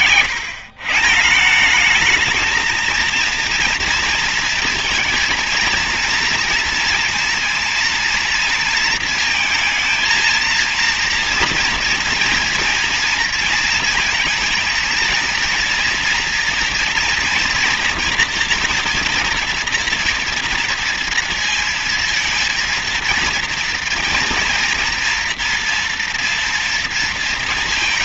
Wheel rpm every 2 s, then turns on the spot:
130, 220, 230, 230, 230, 230, 230, 230, 230, 230, 230, 230, 230, 230.
none